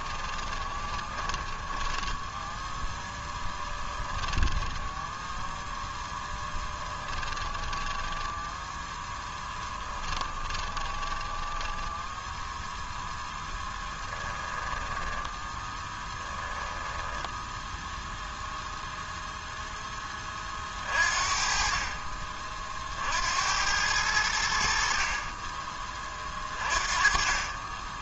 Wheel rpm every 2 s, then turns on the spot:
10, 10, 10, 10, 0, 20, 0, 10, 10, 0, 40, 60, 50, 30.
0-8 10-12 14-18